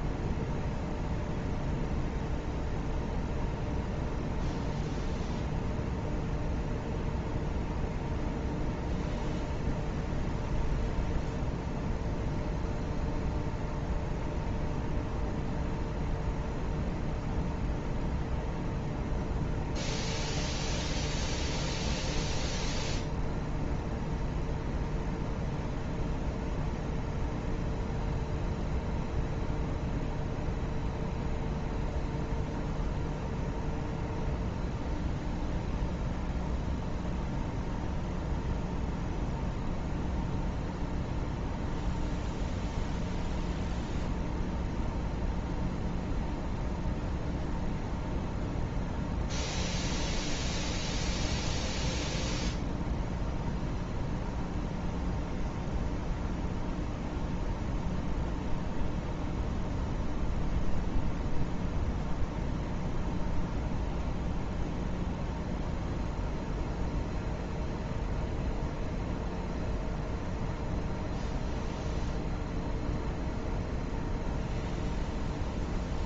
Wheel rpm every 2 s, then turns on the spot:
0, 0, 0, 0, 0, 0, 0, 0, 0, 0, 0, 0, 0, 0, 0, 0, 0, 0, 0, 0, 0, 0, 0, 0, 0, 0, 0, 0, 0, 0, 0, 0, 0, 0, 0, 0, 0, 0.
none